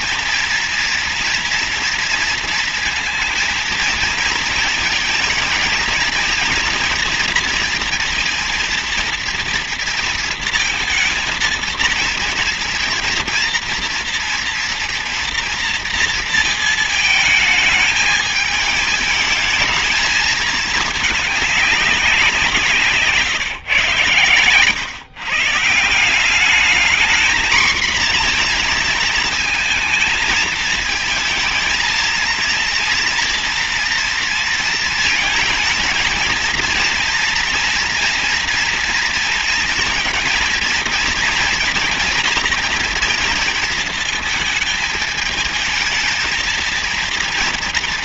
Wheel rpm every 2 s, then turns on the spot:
240, 230, 230, 230, 230, 230, 230, 230, 220, 210, 220, 170, 120, 200, 230, 220, 230, 230, 230, 240, 230, 230, 220, 230.
none